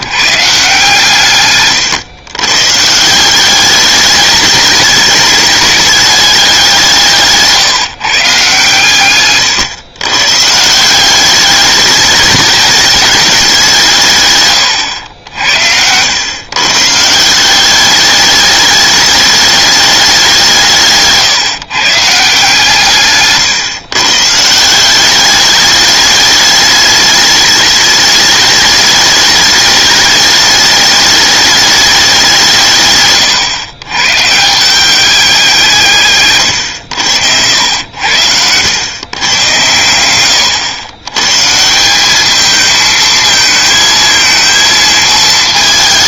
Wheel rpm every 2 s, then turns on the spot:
150, 130, 210, 190, 140, 160, 210, 110, 140, 210, 170, 160, 170, 210, 210, 210, 150, 170, 110, 100, 110, 220, 220.
none